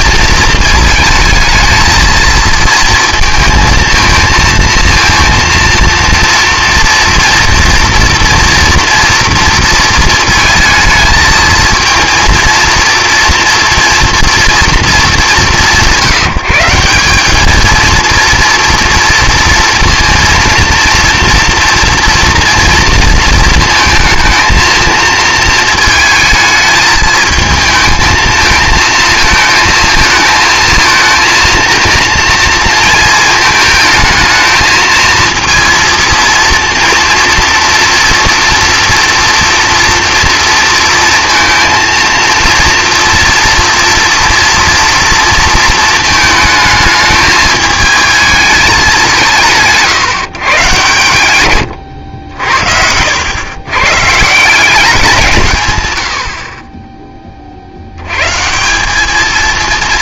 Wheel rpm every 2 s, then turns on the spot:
230, 220, 230, 230, 230, 220, 230, 230, 170, 230, 230, 230, 220, 220, 220, 220, 230, 220, 230, 230, 230, 230, 230, 220, 210, 140, 70, 180, 30, 170.
none